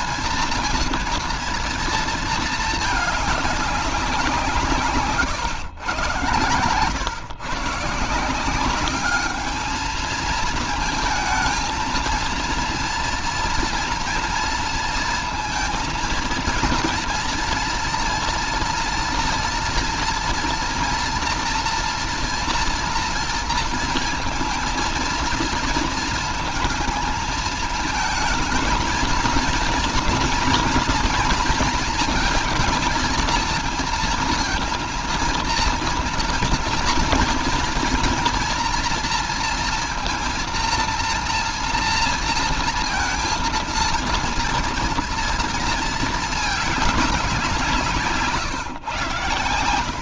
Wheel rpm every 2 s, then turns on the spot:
230, 220, 160, 120, 190, 220, 230, 230, 230, 230, 230, 240, 230, 220, 220, 230, 230, 230, 230, 230, 230, 230, 230, 210, 140.
48-50